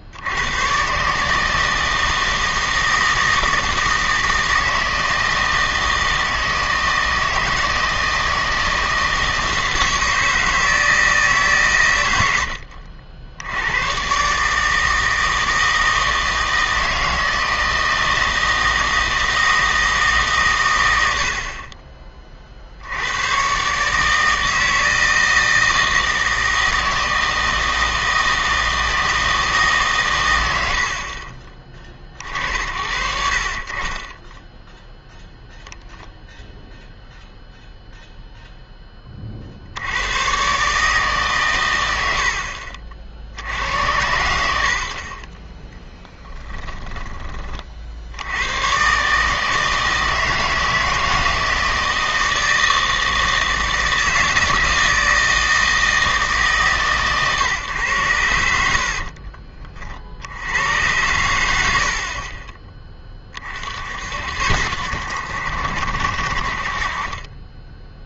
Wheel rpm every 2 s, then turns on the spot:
120, 160, 160, 160, 160, 160, 70, 160, 160, 160, 110, 70, 160, 160, 160, 70, 60, 0, 0, 10, 140, 50, 60, 10, 110, 160, 160, 160, 140, 50, 100, 20, 70, 50.
46-48